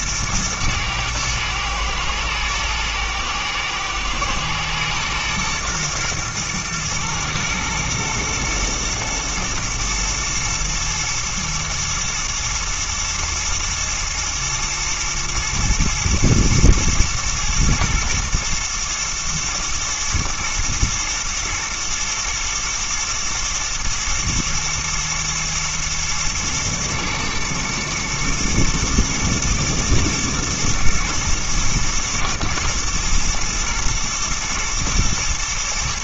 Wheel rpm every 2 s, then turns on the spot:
110, 120, 110, 110, 120, 120, 120, 120, 110, 110, 110, 120, 110, 120, 110, 110, 120, 120.
none